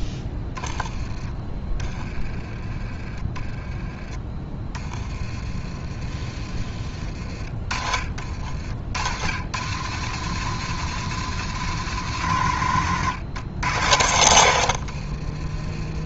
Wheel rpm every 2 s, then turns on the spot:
10, 20, 20, 30, 60, 140, 110, 80.
14-16